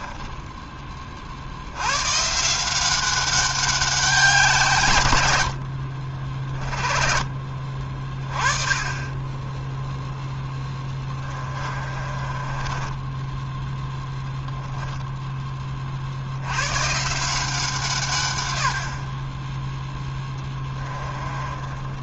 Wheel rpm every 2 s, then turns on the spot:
20, 170, 160, 40, 20, 10, 20, 10, 120, 80, 20.
10-14 20-22